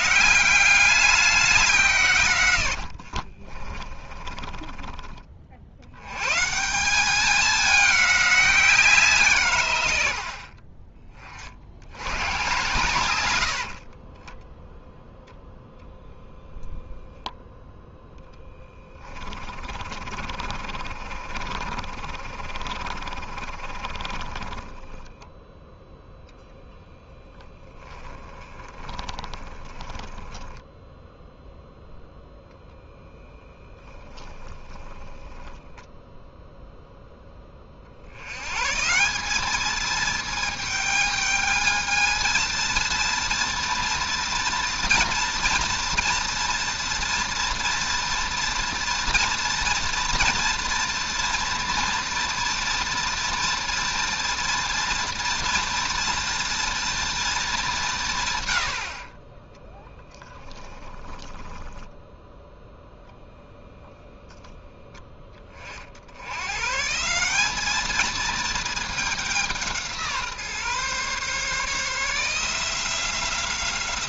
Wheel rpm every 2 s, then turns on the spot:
200, 90, 20, 170, 180, 30, 110, 10, 0, 10, 50, 40, 20, 0, 20, 0, 0, 10, 0, 150, 210, 230, 240, 230, 230, 230, 230, 240, 240, 60, 10, 0, 0, 140, 210, 140, 170.
2-6 18-26 28-30 34-36 60-62